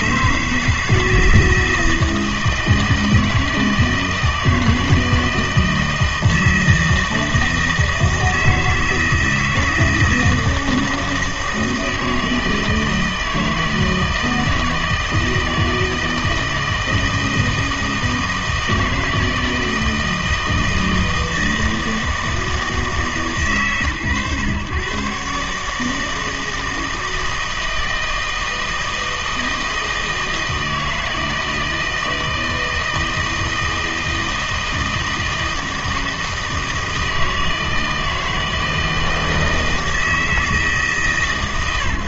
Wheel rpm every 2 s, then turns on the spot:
160, 160, 160, 160, 160, 160, 160, 160, 160, 160, 160, 160, 130, 160, 160, 160, 160, 160, 160, 160, 150.
none